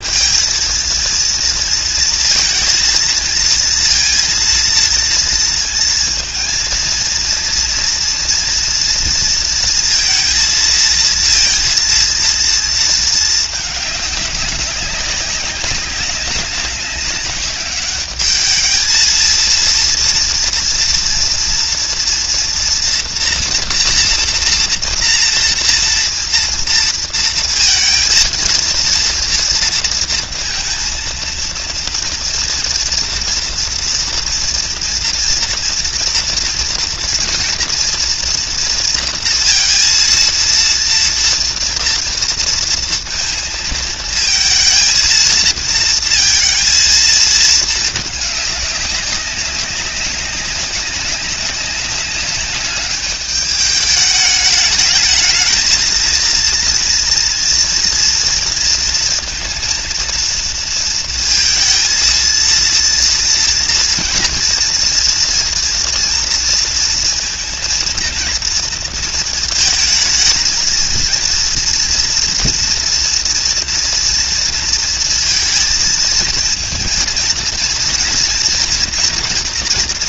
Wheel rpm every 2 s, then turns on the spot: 230, 230, 230, 230, 230, 230, 230, 200, 200, 210, 240, 240, 230, 230, 230, 230, 230, 230, 230, 230, 230, 230, 230, 220, 200, 190, 200, 210, 230, 230, 230, 230, 230, 230, 230, 230, 230, 230, 220, 230.
none